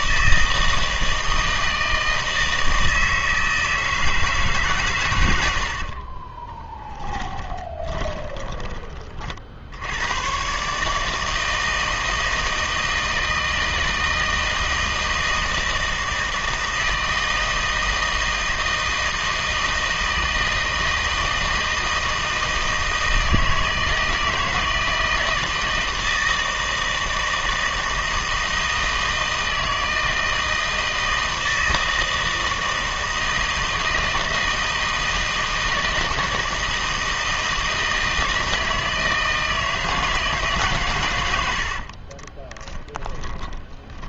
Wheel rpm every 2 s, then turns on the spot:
160, 160, 140, 20, 20, 140, 160, 160, 160, 160, 160, 160, 160, 160, 160, 160, 160, 160, 160, 160, 130, 20.
6-8 42-44